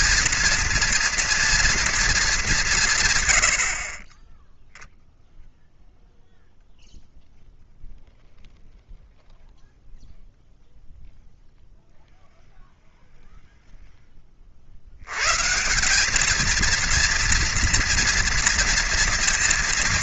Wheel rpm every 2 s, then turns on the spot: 230, 120, 0, 0, 0, 0, 0, 100, 230, 230.
none